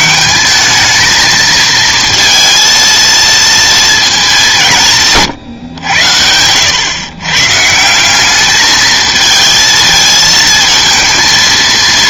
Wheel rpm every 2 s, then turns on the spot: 210, 230, 180, 100, 210, 220.
none